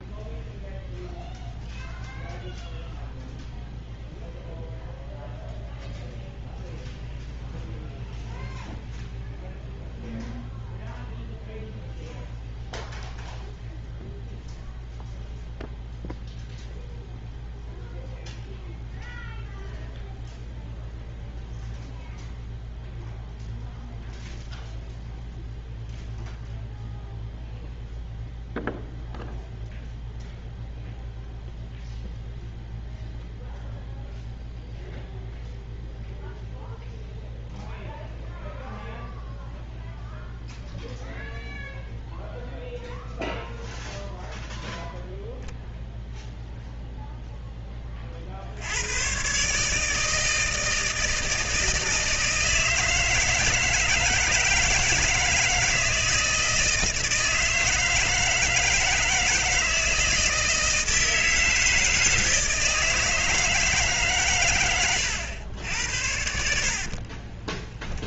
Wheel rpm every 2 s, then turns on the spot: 0, 0, 0, 0, 0, 0, 0, 0, 0, 0, 0, 0, 0, 0, 0, 0, 0, 0, 0, 0, 0, 0, 0, 0, 100, 160, 160, 160, 160, 160, 160, 160, 100, 50.
64-68